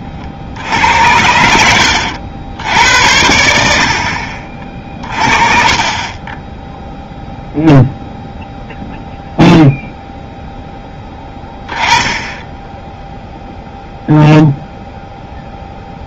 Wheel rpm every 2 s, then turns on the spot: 70, 90, 40, 0, 0, 10, 10, 0.
none